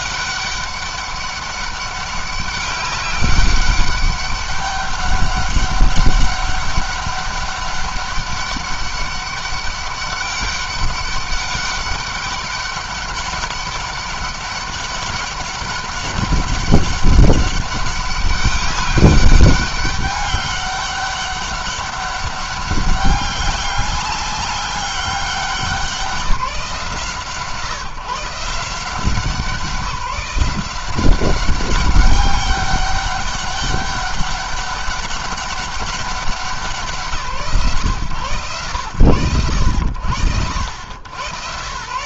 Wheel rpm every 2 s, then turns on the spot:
200, 200, 200, 200, 200, 200, 200, 200, 200, 200, 200, 200, 200, 160, 180, 190, 200, 190, 180, 110, 80.
none